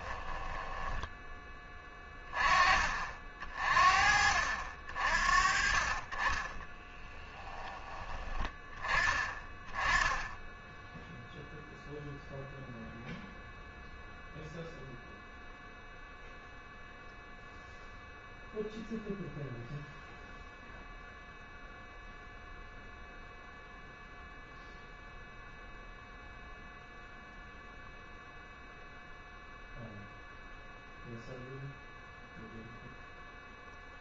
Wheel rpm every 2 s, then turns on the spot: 10, 30, 60, 20, 20, 10, 0, 0, 0, 0, 0, 0, 0, 0, 0, 0, 0.
0-2 6-8